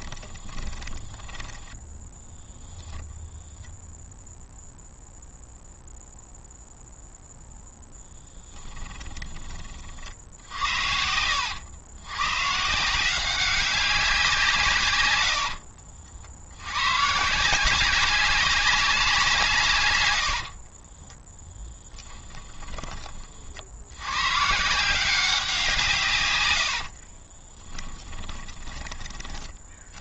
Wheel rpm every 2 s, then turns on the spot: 20, 0, 0, 0, 10, 70, 150, 130, 110, 190, 40, 30, 170, 90, 20.
0-2 8-10 20-24 26-28